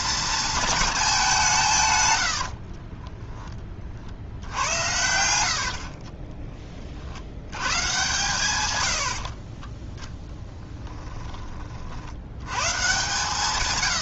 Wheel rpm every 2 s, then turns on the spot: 220, 60, 80, 30, 120, 10, 120.
2-4 10-12